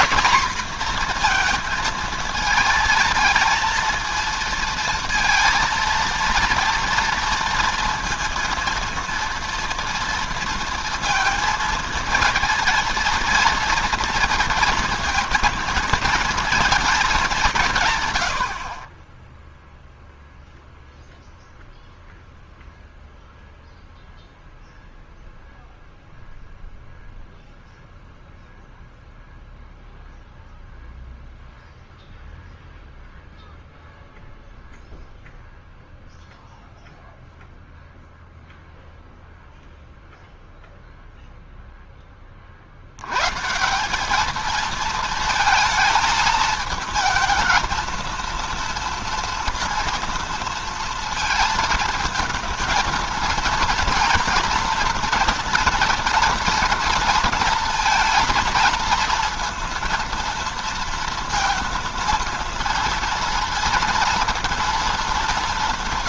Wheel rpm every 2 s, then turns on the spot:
240, 230, 230, 230, 230, 230, 230, 230, 220, 60, 0, 0, 0, 0, 0, 0, 0, 0, 0, 0, 0, 60, 220, 220, 230, 230, 230, 240, 230, 230, 230, 230, 230.
none